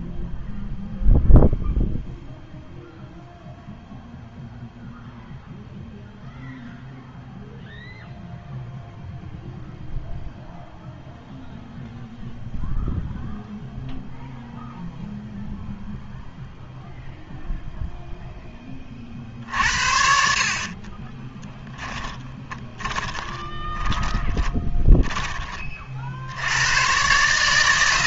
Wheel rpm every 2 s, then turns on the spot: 0, 0, 0, 0, 0, 0, 0, 0, 0, 20, 40, 20, 30, 110.
20-26